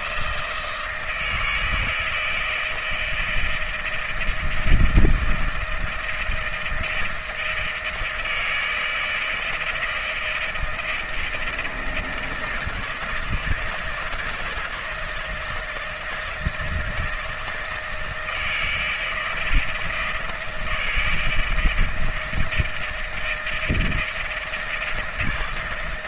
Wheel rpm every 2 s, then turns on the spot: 160, 160, 160, 160, 160, 160, 160, 160, 170, 160, 160, 160, 160.
none